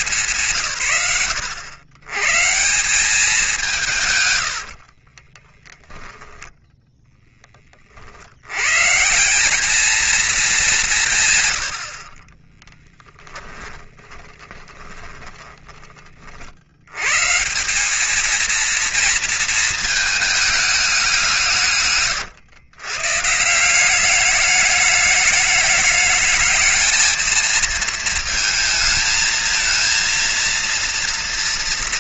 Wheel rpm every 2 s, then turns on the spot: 120, 110, 0, 100, 210, 20, 20, 60, 220, 220, 110, 200, 220, 220, 230, 230.
10-14